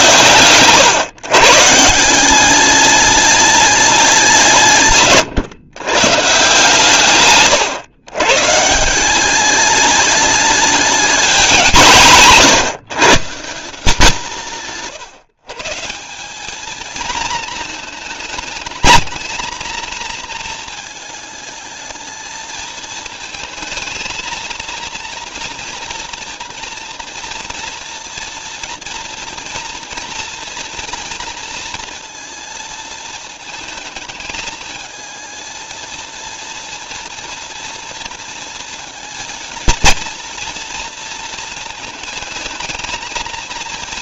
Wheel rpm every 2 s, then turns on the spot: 130, 210, 160, 140, 160, 210, 150, 160, 220, 220, 220, 220, 230, 230, 230, 230, 220, 220, 230, 230, 230, 230.
none